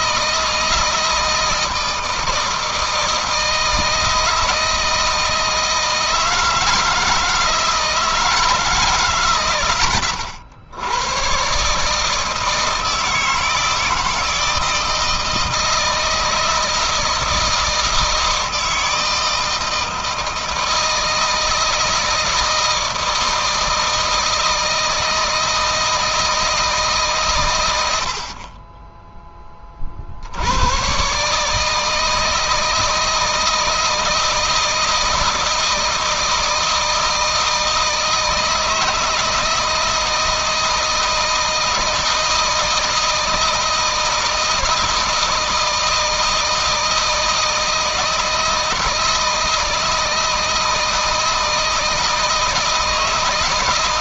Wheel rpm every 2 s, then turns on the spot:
160, 160, 160, 160, 140, 100, 160, 160, 160, 160, 160, 160, 160, 150, 20, 110, 160, 160, 160, 160, 160, 170, 160, 160, 160, 160, 160.
none